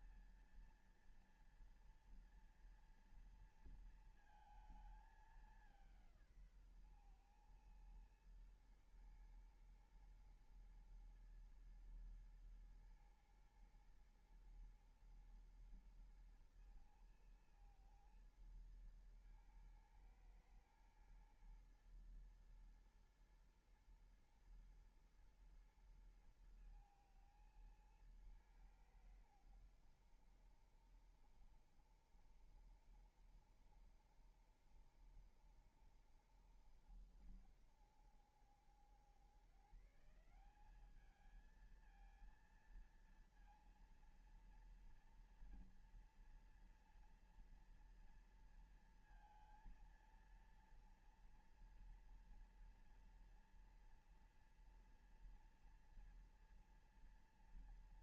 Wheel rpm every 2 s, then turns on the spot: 230, 230, 220, 150, 110, 120, 110, 110, 110, 110, 120, 120, 120, 110, 110, 80, 70, 70, 60, 70, 150, 230, 230, 230, 230, 230, 230, 230, 230.
none